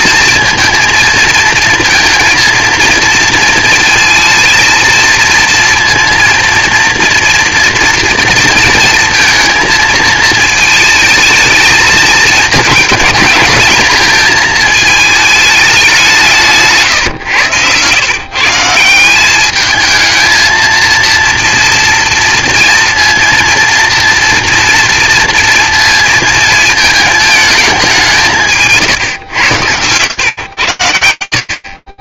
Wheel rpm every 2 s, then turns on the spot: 220, 230, 230, 240, 230, 220, 220, 220, 150, 160, 230, 230, 230, 220, 150, 110.
none